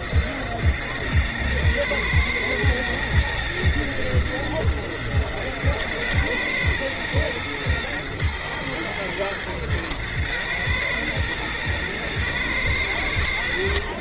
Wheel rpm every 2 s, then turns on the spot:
110, 110, 110, 120, 110, 110, 110.
none